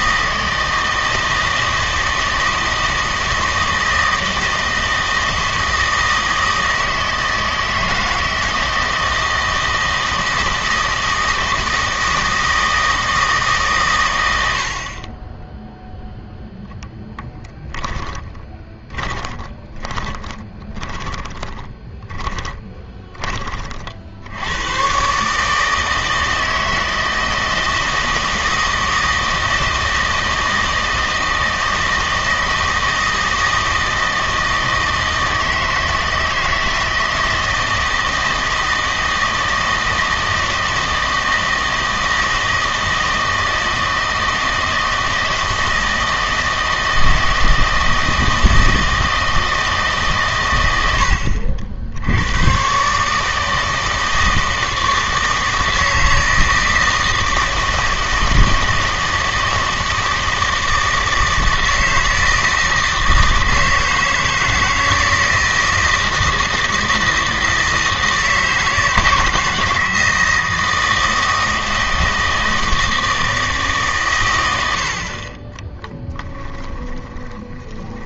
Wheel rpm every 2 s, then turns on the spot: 160, 160, 160, 160, 160, 160, 160, 70, 10, 20, 20, 20, 100, 160, 160, 160, 160, 160, 160, 160, 160, 160, 160, 160, 160, 100, 130, 160, 160, 160, 160, 160, 160, 160, 160, 160, 160, 80, 20.
18-24 76-78